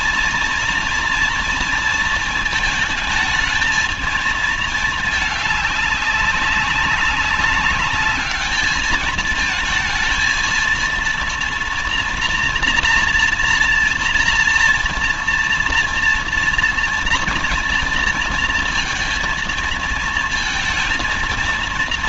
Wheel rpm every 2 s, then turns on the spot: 230, 230, 220, 200, 210, 230, 240, 230, 230, 230, 230.
none